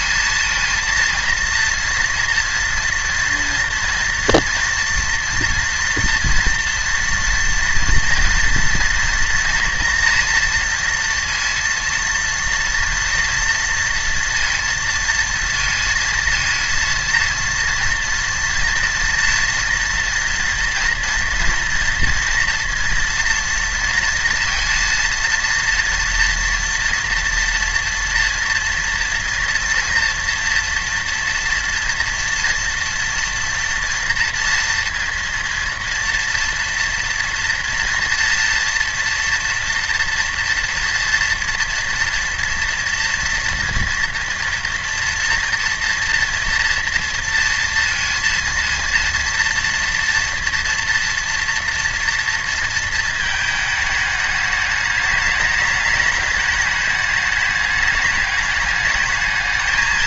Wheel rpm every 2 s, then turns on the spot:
230, 230, 230, 230, 230, 230, 230, 230, 230, 230, 230, 230, 230, 240, 230, 240, 230, 230, 240, 240, 230, 240, 230, 230, 230, 230, 230, 210, 210, 210.
none